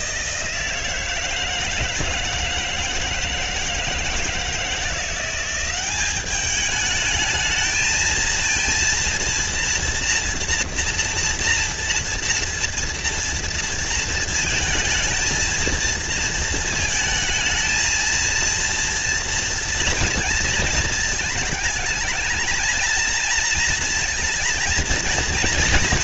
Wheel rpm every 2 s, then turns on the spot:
170, 170, 170, 210, 230, 230, 230, 230, 220, 230, 220, 220, 230.
none